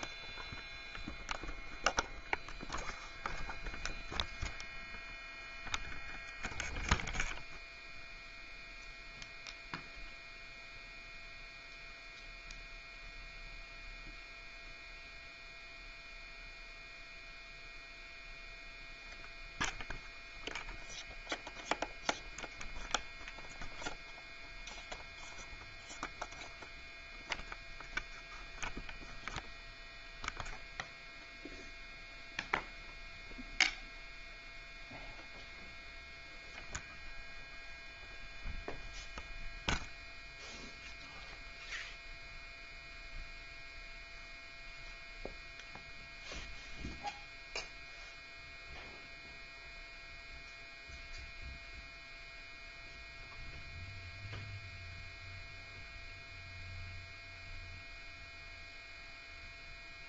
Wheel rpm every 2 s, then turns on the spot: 0, 0, 0, 0, 0, 0, 0, 0, 0, 0, 0, 0, 0, 0, 0, 0, 0, 0, 0, 0, 0, 0, 0, 0, 0, 0, 0, 0, 0, 0.
none